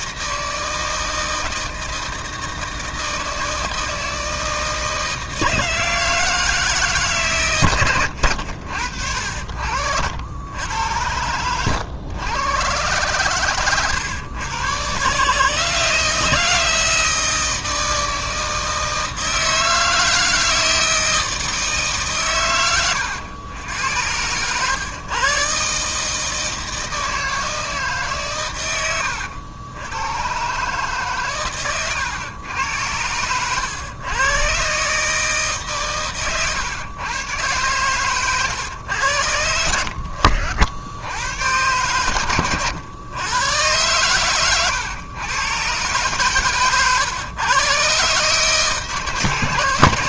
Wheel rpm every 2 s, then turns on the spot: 160, 160, 160, 160, 80, 80, 110, 120, 160, 160, 160, 110, 110, 160, 120, 130, 100, 130, 110, 120, 70, 110, 110, 120, 150.
none